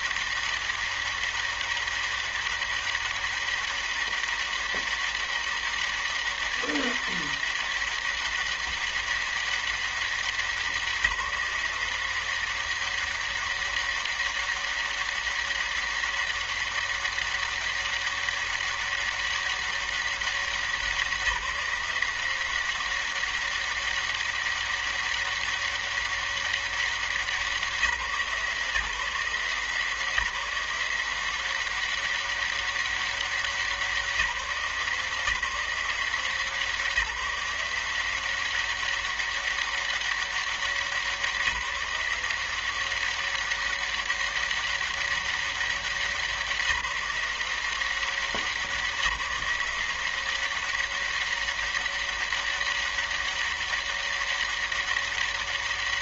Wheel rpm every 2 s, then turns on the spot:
200, 200, 200, 200, 200, 190, 180, 200, 200, 200, 200, 180, 200, 200, 160, 180, 200, 180, 170, 190, 200, 170, 200, 190, 190, 180, 200, 200.
none